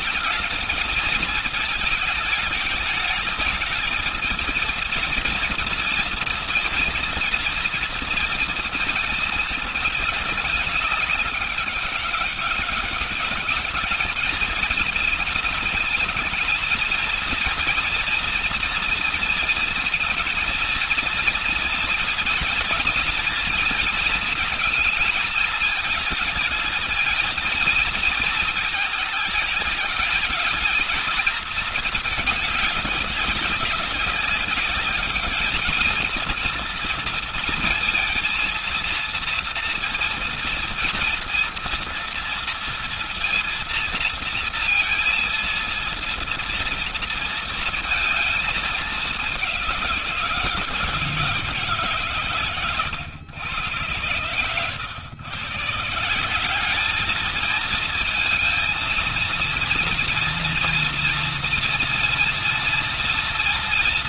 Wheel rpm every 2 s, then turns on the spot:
220, 210, 230, 230, 230, 200, 200, 220, 220, 230, 230, 230, 220, 230, 220, 220, 210, 200, 230, 230, 230, 230, 230, 230, 220, 170, 120, 110, 190, 220, 230, 230.
none